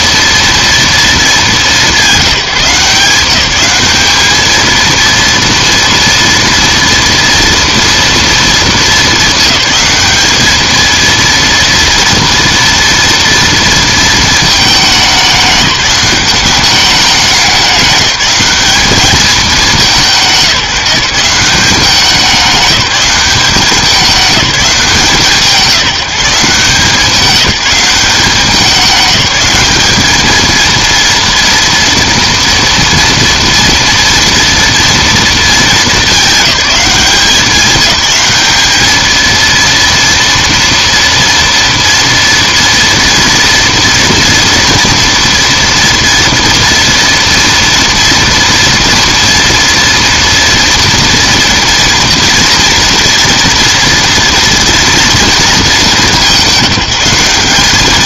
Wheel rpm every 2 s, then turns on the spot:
230, 180, 230, 230, 220, 220, 230, 210, 200, 200, 170, 200, 180, 170, 200, 230, 230, 230, 210, 210, 230, 230, 240, 230, 230, 230, 230, 230, 190.
none